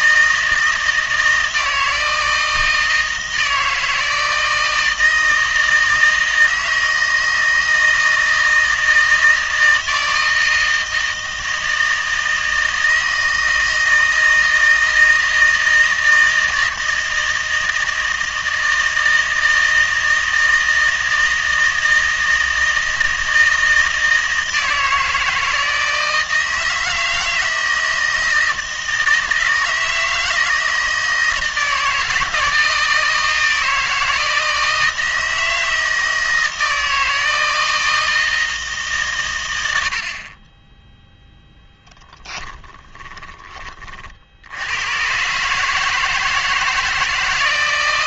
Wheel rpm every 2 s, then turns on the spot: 160, 160, 160, 160, 160, 160, 160, 160, 160, 160, 160, 160, 160, 160, 160, 160, 160, 160, 160, 150, 20, 10, 90, 160.
42-44